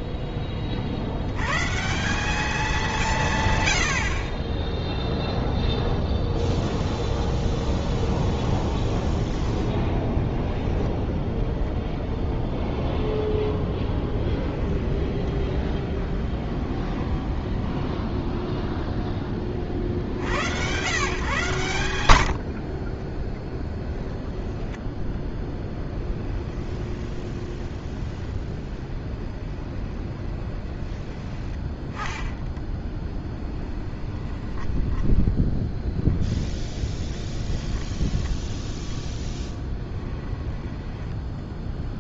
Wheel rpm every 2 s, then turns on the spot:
30, 190, 10, 0, 0, 0, 0, 10, 20, 0, 100, 50, 20, 20, 20, 20, 10, 20, 10, 10, 10.
14-18 24-36